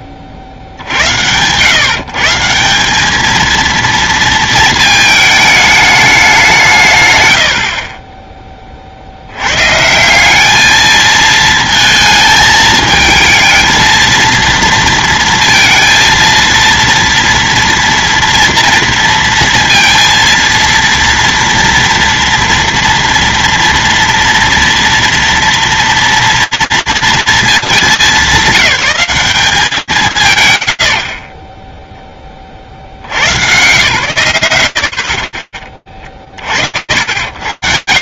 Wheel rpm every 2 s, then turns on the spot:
60, 210, 220, 140, 40, 220, 220, 230, 230, 230, 230, 230, 230, 230, 190, 10, 100, 90, 10.
none